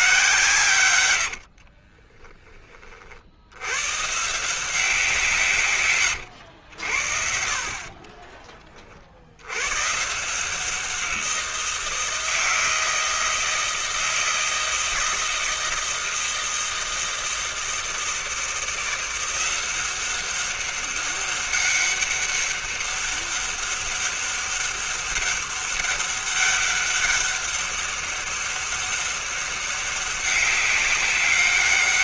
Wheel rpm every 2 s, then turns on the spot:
140, 10, 160, 90, 30, 160, 170, 160, 160, 170, 200, 200, 200, 200, 200, 200.
none